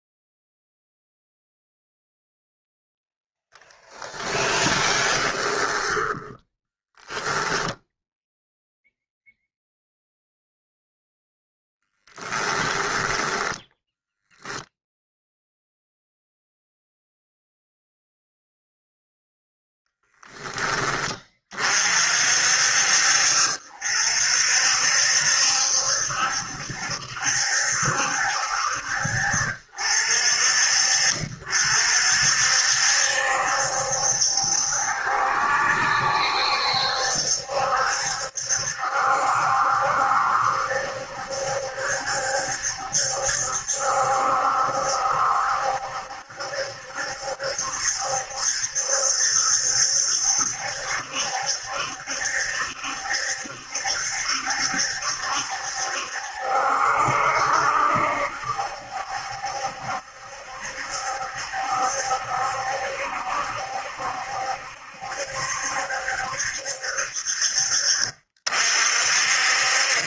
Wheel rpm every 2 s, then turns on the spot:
0, 10, 20, 10, 0, 0, 10, 0, 0, 0, 10, 60, 60, 70, 60, 50, 60, 70, 70, 70, 70, 70, 70, 70, 70, 70, 70, 70, 70, 70, 70, 70, 70, 70, 40.
4-8 12-14